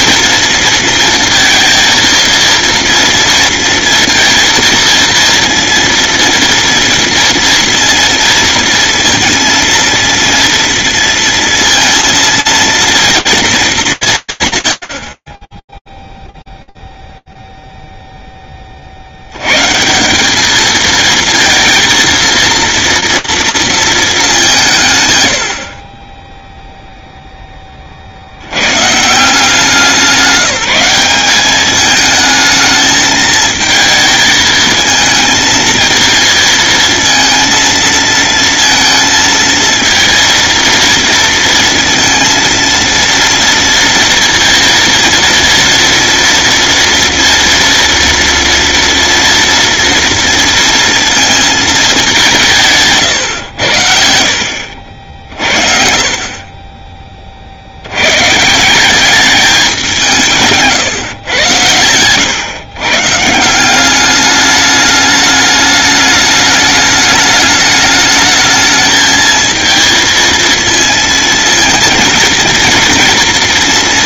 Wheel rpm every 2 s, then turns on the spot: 230, 230, 230, 230, 230, 240, 230, 100, 0, 40, 220, 230, 160, 0, 140, 190, 220, 220, 230, 230, 230, 230, 230, 230, 230, 230, 140, 60, 30, 200, 130, 150, 210, 210, 220, 230, 230.
none